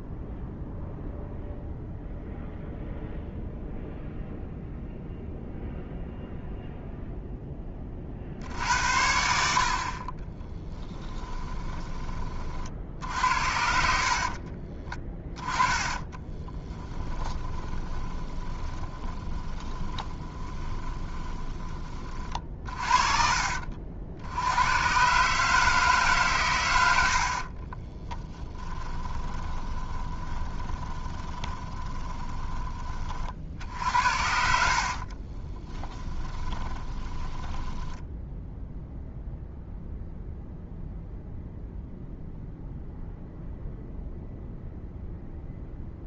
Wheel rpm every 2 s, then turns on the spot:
0, 0, 0, 0, 70, 10, 60, 20, 10, 20, 20, 30, 110, 100, 20, 20, 20, 60, 30, 0, 0, 0, 0.
10-12 14-22 28-32 34-38